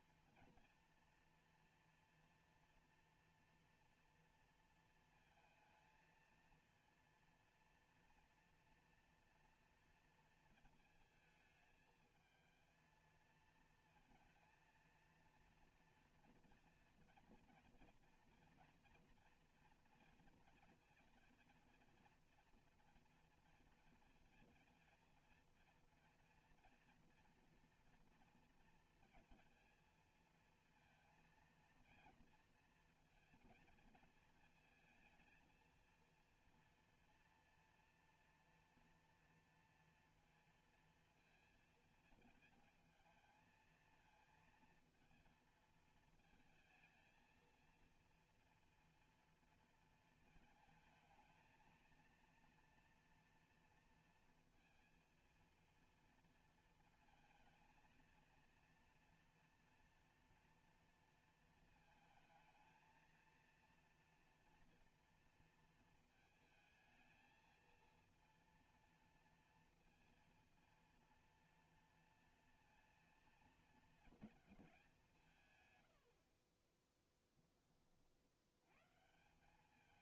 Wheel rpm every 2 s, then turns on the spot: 230, 230, 230, 230, 230, 220, 220, 230, 230, 230, 230, 230, 230, 230, 230, 230, 230, 220, 230, 230, 230, 220, 230, 230, 230, 220, 230, 230, 230, 230, 230, 220, 230, 220, 230, 230, 230, 210, 20, 110.
76-78